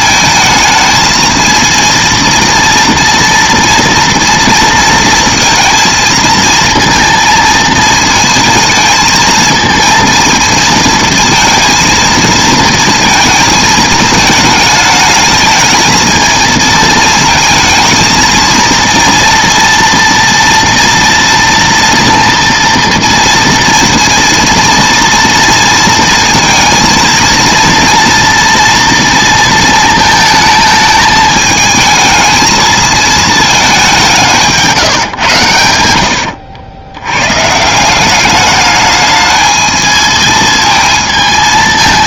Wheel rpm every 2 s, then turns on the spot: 220, 230, 230, 230, 220, 230, 230, 220, 220, 230, 230, 230, 230, 230, 230, 220, 220, 160, 80, 210, 220.
none